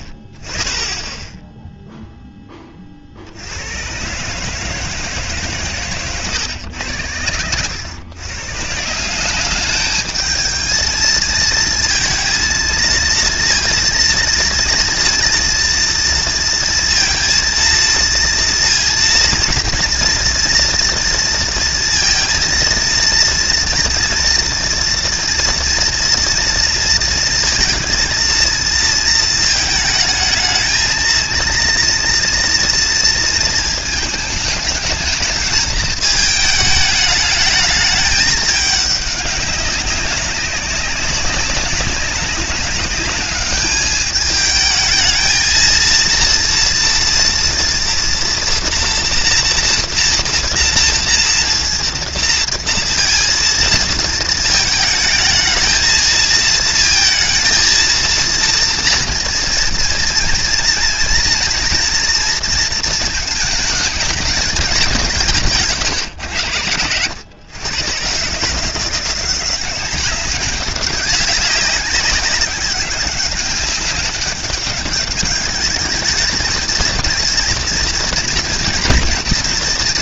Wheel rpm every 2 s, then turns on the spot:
0, 20, 140, 110, 150, 220, 230, 230, 230, 230, 230, 230, 230, 230, 230, 220, 240, 210, 220, 210, 200, 200, 220, 230, 230, 230, 230, 220, 230, 230, 230, 230, 210, 100, 150, 200, 200, 200, 220, 230.
none